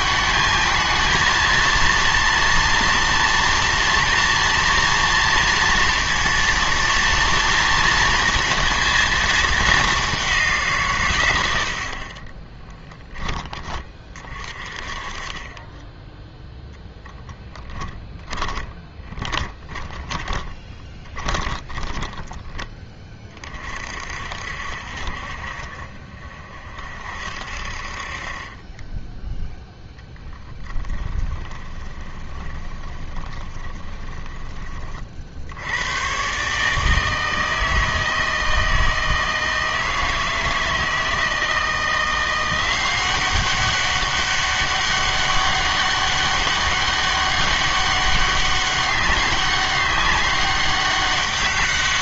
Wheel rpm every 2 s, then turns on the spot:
220, 230, 230, 240, 230, 170, 30, 40, 0, 10, 20, 20, 60, 40, 20, 10, 20, 30, 150, 160, 160, 180, 200, 200, 200, 200.
12-14 18-22 30-34